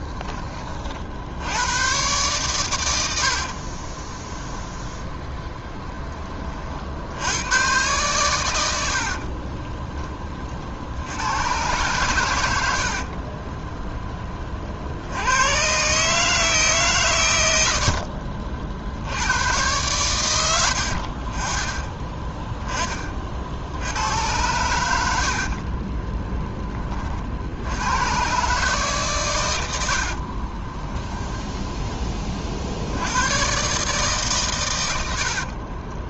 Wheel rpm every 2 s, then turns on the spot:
30, 110, 0, 60, 90, 50, 80, 50, 150, 70, 80, 20, 90, 20, 140, 20, 70, 110.
30-32